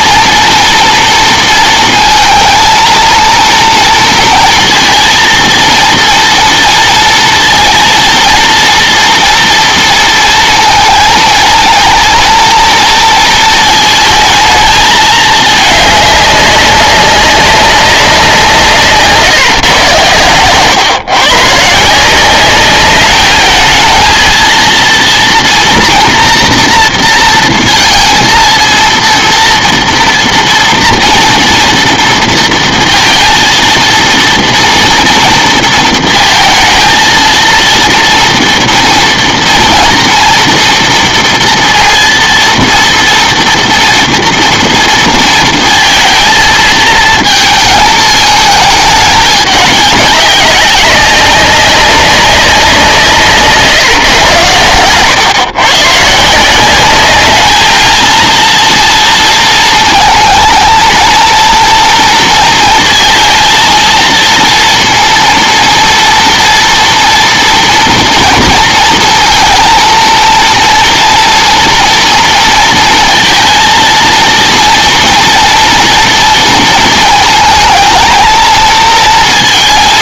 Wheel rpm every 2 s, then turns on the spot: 230, 230, 230, 230, 230, 230, 230, 220, 200, 170, 130, 200, 230, 230, 230, 230, 230, 230, 230, 230, 230, 230, 230, 230, 210, 200, 180, 110, 190, 230, 230, 230, 230, 230, 230, 230, 230, 230, 230, 220.
none